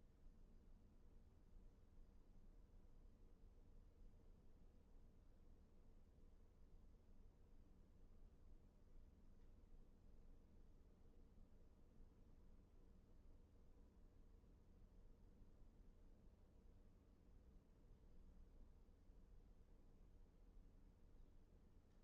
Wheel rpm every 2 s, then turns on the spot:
0, 0, 0, 0, 0, 0, 0, 0, 0, 0, 0.
none